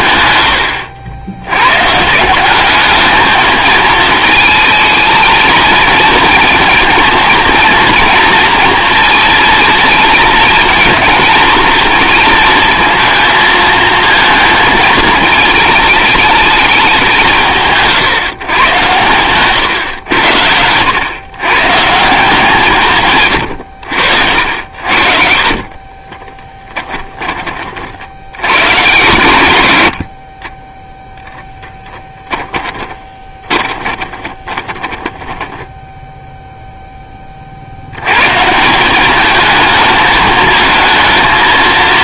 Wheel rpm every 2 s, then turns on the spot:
100, 200, 220, 230, 230, 230, 230, 220, 210, 110, 90, 160, 70, 10, 100, 20, 20, 20, 0, 180, 230.
0-2 24-28 32-36